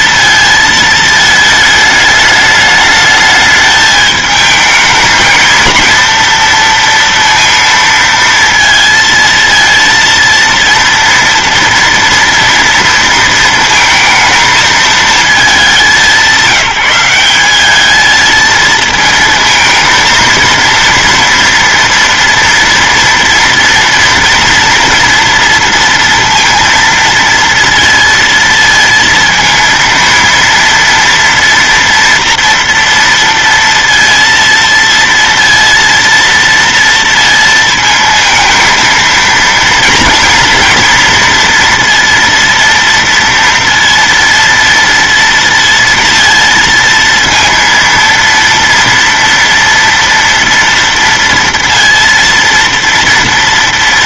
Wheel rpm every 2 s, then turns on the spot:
220, 210, 220, 230, 230, 230, 230, 220, 190, 220, 230, 230, 230, 230, 230, 230, 230, 230, 230, 230, 230, 230, 230, 230, 230, 230, 230.
none